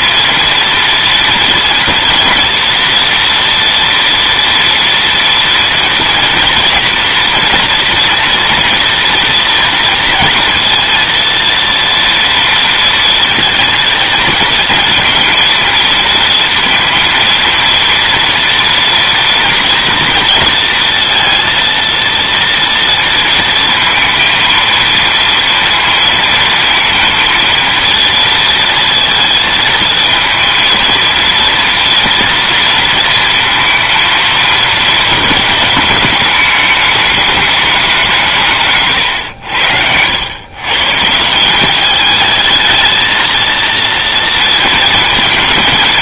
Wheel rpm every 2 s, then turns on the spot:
230, 240, 230, 230, 230, 230, 230, 230, 230, 230, 230, 230, 230, 230, 230, 230, 230, 220, 210, 140, 130, 220, 230.
none